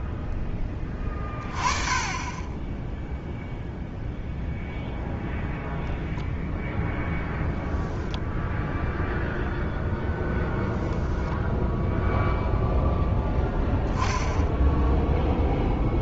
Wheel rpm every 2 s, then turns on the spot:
10, 10, 0, 0, 0, 0, 0, 0.
none